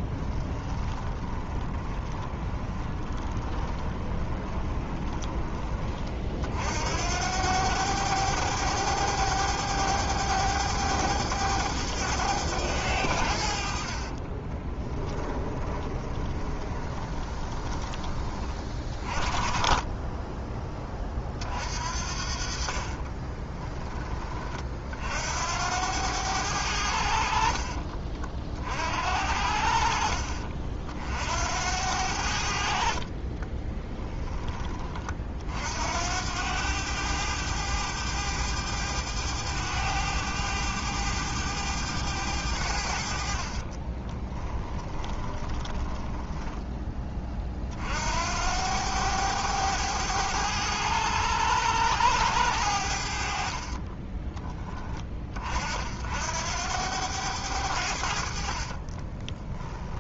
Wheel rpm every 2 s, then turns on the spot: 10, 20, 20, 70, 100, 100, 90, 20, 20, 10, 30, 30, 50, 80, 60, 50, 50, 30, 100, 100, 100, 70, 10, 20, 100, 100, 80, 20, 90, 20.
0-6 14-18 22-24 44-46 58-60